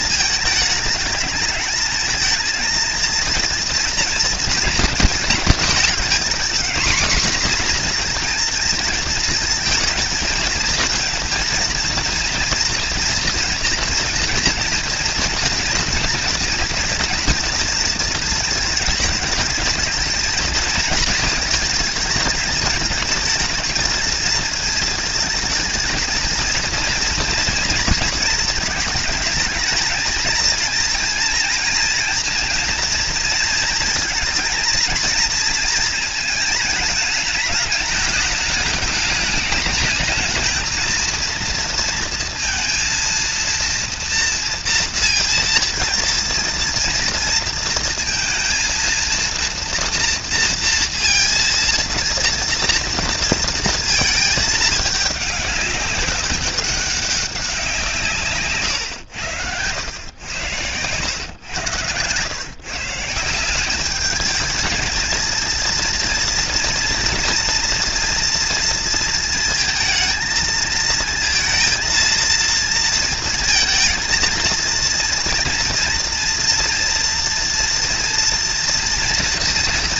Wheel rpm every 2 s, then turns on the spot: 210, 220, 230, 240, 240, 230, 230, 240, 230, 230, 220, 220, 220, 230, 230, 220, 230, 230, 220, 210, 220, 230, 230, 230, 230, 230, 230, 220, 200, 140, 90, 120, 210, 230, 230, 230, 230, 230, 230, 230.
none